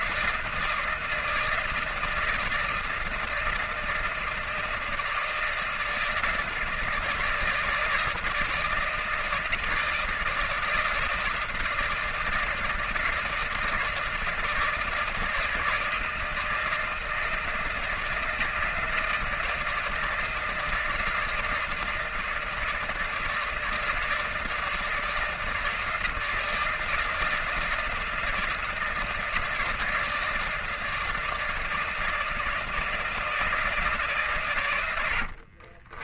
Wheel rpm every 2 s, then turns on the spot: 160, 160, 160, 160, 160, 160, 160, 160, 160, 160, 160, 160, 160, 160, 160, 160, 160, 90.
34-36